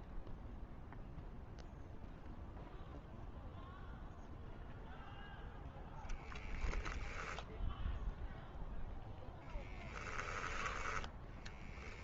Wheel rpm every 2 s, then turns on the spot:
0, 0, 10, 0, 20, 40.
8-10